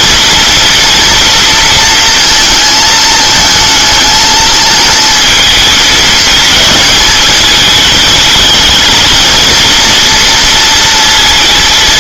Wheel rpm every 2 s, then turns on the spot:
230, 220, 220, 220, 220, 230.
none